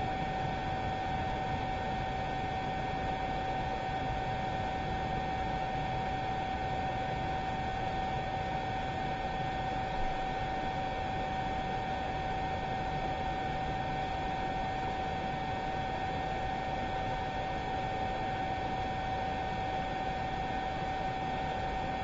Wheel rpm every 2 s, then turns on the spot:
0, 0, 0, 0, 0, 0, 0, 0, 0, 0, 0.
none